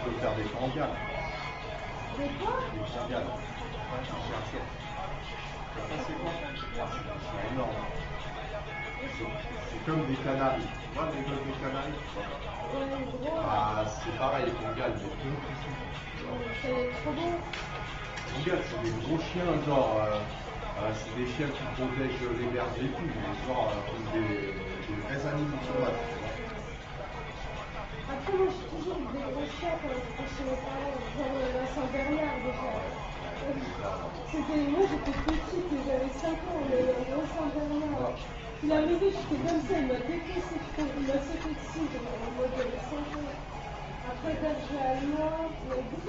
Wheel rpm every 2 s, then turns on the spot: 0, 0, 0, 0, 0, 0, 0, 0, 0, 0, 0, 0, 0, 0, 0, 0, 0, 0, 0, 0, 0, 0, 0.
none